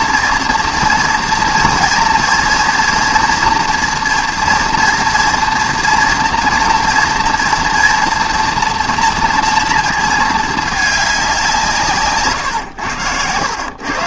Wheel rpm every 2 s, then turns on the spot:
240, 230, 240, 230, 230, 210, 110.
none